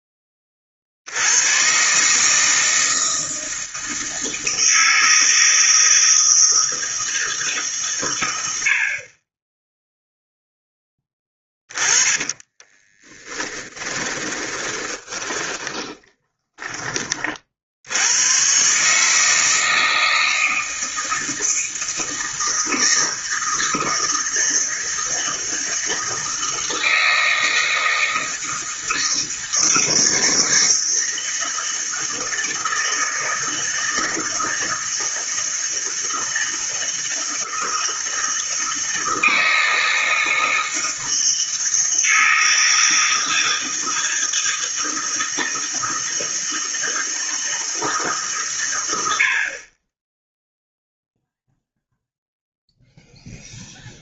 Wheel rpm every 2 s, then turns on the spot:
40, 160, 160, 160, 70, 10, 20, 20, 20, 140, 160, 160, 160, 160, 160, 160, 160, 160, 160, 160, 160, 160, 160, 160, 120, 0, 0.
12-16